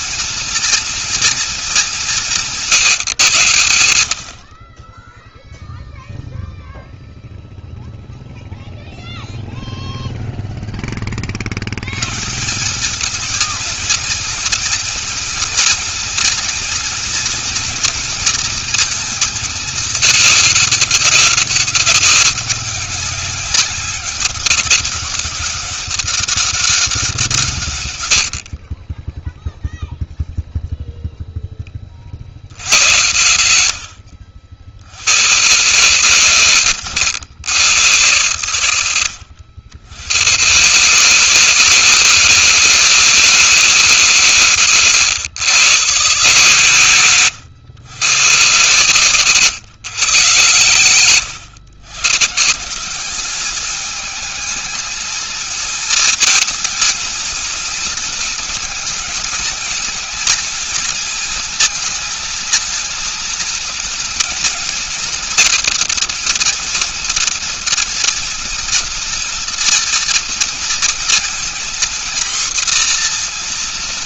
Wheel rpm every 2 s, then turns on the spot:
230, 130, 20, 0, 0, 20, 200, 230, 240, 230, 200, 190, 200, 180, 20, 0, 80, 70, 110, 110, 140, 160, 110, 120, 140, 100, 190, 220, 230, 220, 220, 230, 230, 230, 230, 230, 240.
none